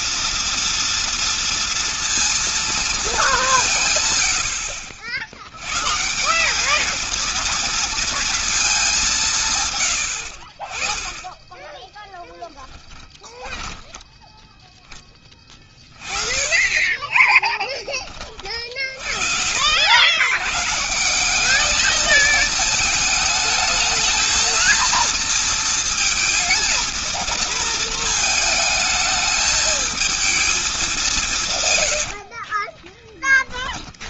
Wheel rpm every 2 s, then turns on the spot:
230, 220, 80, 220, 180, 20, 20, 10, 20, 40, 160, 220, 230, 230, 220, 190, 20.
12-14 16-18 32-34